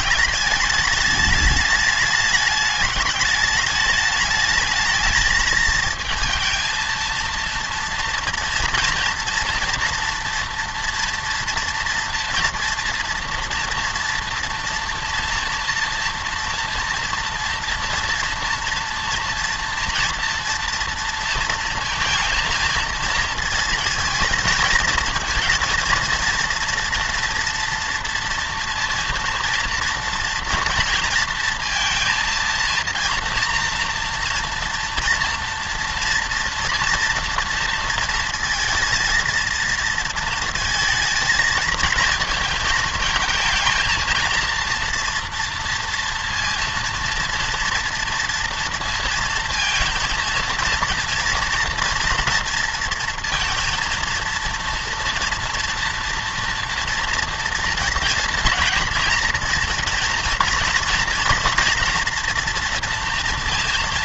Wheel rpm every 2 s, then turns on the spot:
210, 210, 220, 230, 230, 230, 230, 230, 230, 230, 230, 230, 230, 230, 230, 230, 230, 240, 240, 230, 230, 220, 230, 230, 230, 230, 230, 230, 230, 240, 240, 230.
none